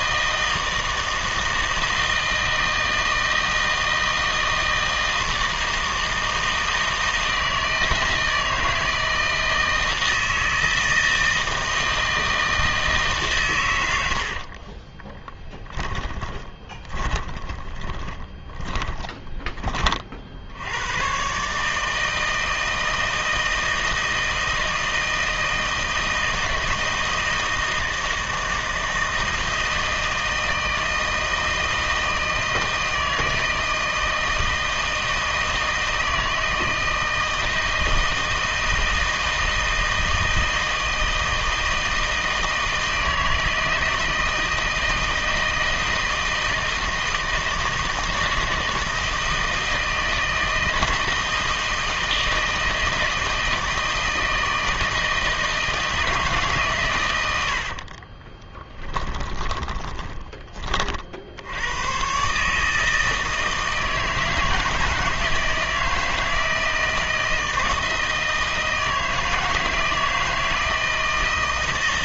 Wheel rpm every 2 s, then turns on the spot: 160, 160, 160, 160, 160, 160, 160, 40, 30, 20, 80, 160, 160, 160, 160, 160, 160, 160, 160, 160, 160, 160, 160, 160, 160, 160, 160, 160, 140, 20, 30, 160, 160, 160, 160, 160.
14-20 58-60